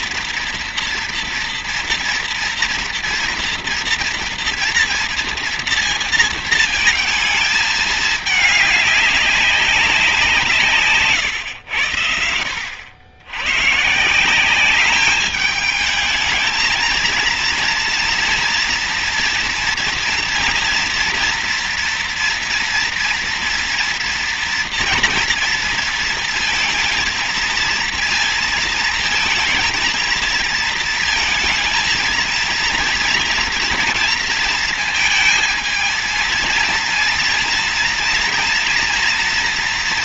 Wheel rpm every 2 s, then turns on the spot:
240, 230, 230, 220, 200, 150, 80, 200, 230, 230, 230, 230, 230, 230, 220, 230, 230, 230, 230, 230.
none